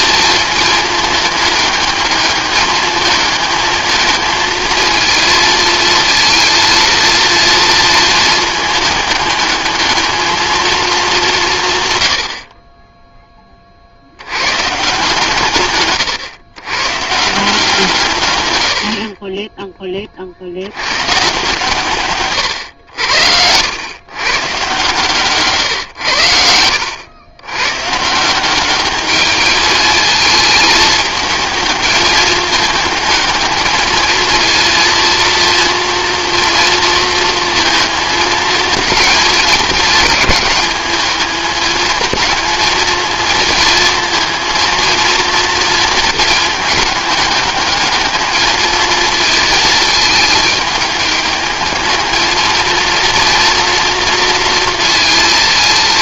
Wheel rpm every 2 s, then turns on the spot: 220, 220, 230, 230, 220, 220, 20, 150, 140, 70, 100, 100, 140, 90, 200, 220, 210, 230, 230, 220, 210, 220, 230, 210, 220, 210, 220, 230.
none